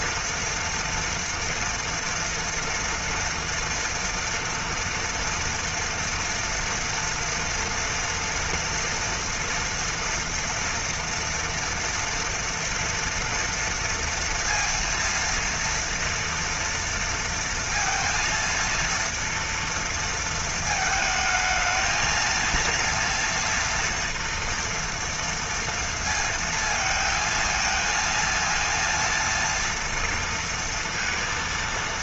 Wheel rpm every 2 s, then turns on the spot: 230, 230, 230, 230, 230, 230, 240, 230, 230, 230, 220, 230, 230, 230, 230, 230.
none